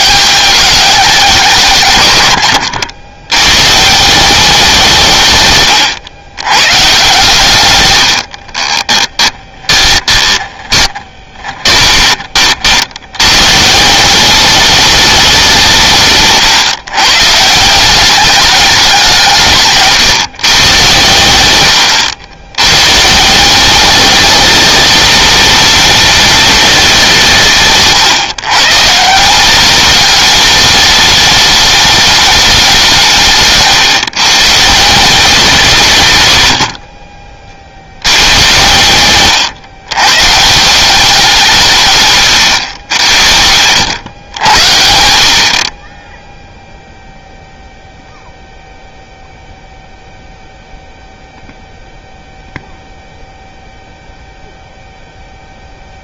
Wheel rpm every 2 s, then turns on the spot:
210, 90, 170, 120, 20, 20, 70, 200, 130, 190, 120, 120, 210, 190, 160, 210, 180, 160, 50, 110, 180, 80, 70, 0, 0, 0, 0, 0.
8-12